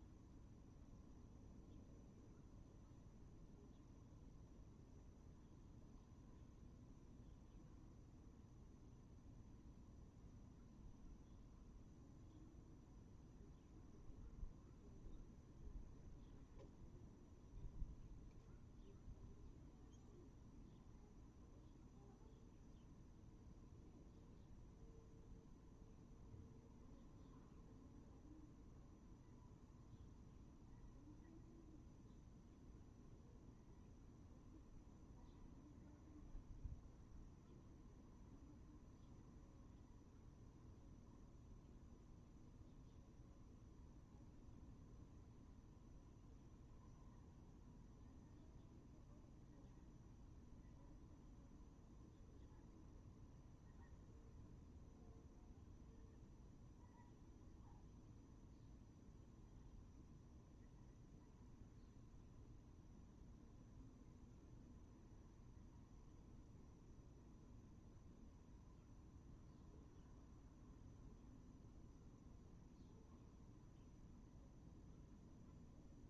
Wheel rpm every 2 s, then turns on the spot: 0, 0, 0, 0, 0, 0, 0, 0, 0, 0, 0, 0, 0, 0, 0, 0, 0, 0, 0, 0, 0, 0, 0, 0, 0, 0, 0, 0, 0, 0, 0, 0, 0, 0, 0, 0, 0, 0.
none